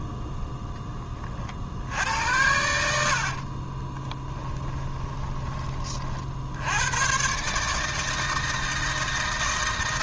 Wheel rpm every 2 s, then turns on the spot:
0, 80, 20, 80, 160.
2-6